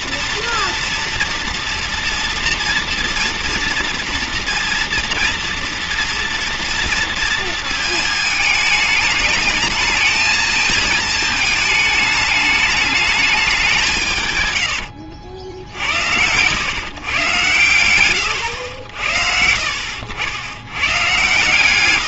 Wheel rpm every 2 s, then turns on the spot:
240, 240, 230, 230, 210, 220, 220, 120, 110, 100, 110.
14-16